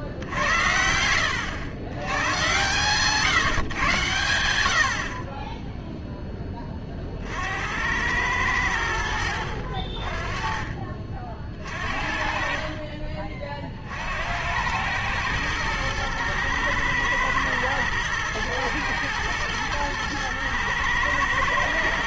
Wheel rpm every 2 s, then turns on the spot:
80, 130, 90, 20, 90, 30, 40, 90, 110, 120, 110.
12-14